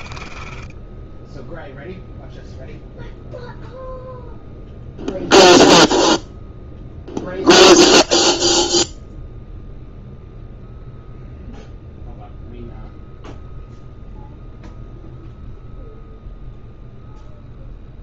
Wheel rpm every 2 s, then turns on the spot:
10, 0, 0, 0, 0, 0, 0, 0, 0.
0-2